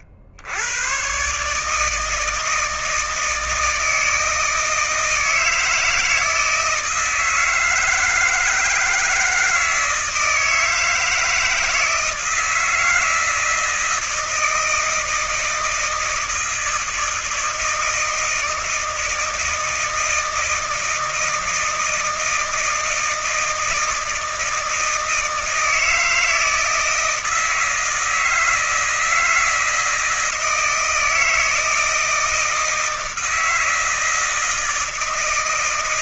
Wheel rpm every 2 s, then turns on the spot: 80, 160, 160, 160, 160, 160, 160, 160, 160, 160, 160, 160, 160, 160, 160, 160, 160, 160.
none